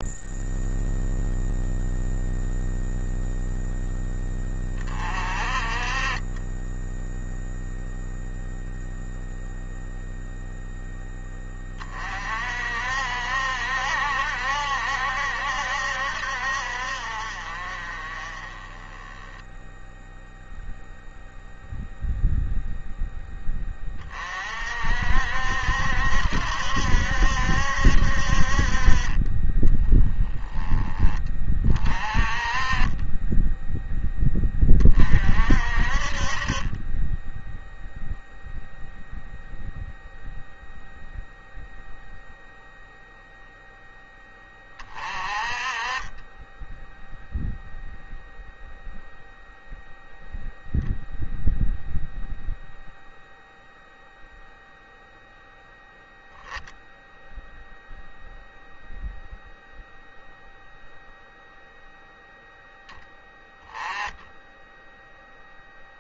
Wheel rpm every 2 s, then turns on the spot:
0, 0, 20, 20, 0, 0, 50, 70, 60, 20, 0, 0, 40, 70, 50, 20, 30, 20, 30, 0, 0, 0, 20, 10, 0, 0, 0, 0, 0, 0, 0, 0, 10.
none